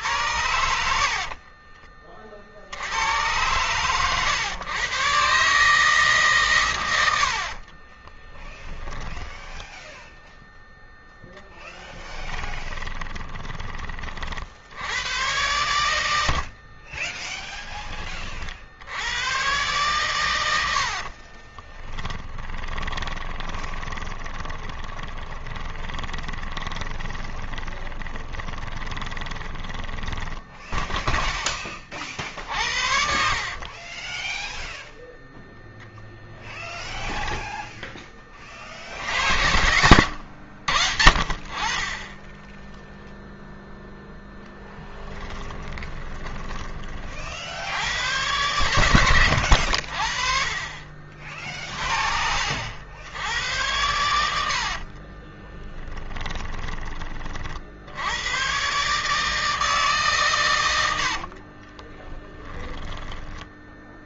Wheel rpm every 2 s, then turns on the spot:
70, 60, 120, 130, 10, 0, 20, 60, 70, 40, 90, 30, 20, 20, 20, 10, 50, 10, 10, 30, 80, 10, 0, 20, 110, 50, 60, 70, 20, 110, 120, 10.
0-2 8-10 12-14 16-18 20-32 34-38 54-58 62-64